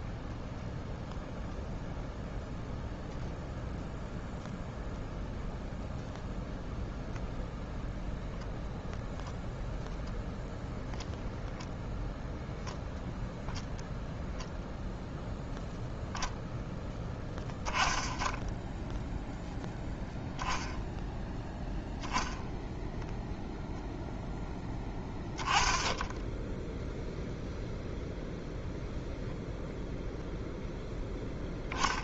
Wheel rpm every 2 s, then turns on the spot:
0, 0, 0, 0, 0, 0, 10, 0, 0, 10, 0, 0, 0, 0, 0, 0.
none